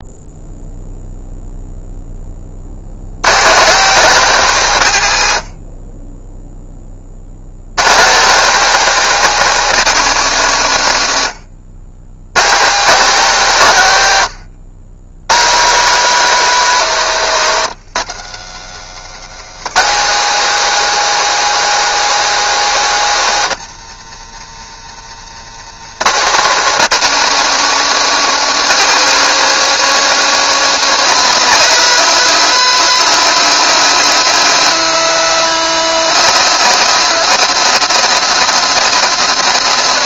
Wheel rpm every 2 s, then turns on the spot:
0, 60, 180, 10, 200, 180, 140, 100, 210, 210, 220, 230, 240, 220, 230, 230, 220, 230, 230, 230.
none